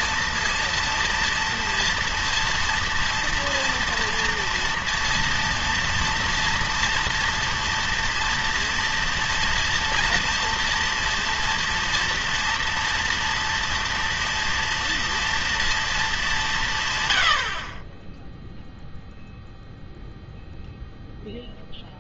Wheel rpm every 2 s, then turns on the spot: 230, 230, 230, 230, 230, 230, 230, 230, 160, 0, 0.
none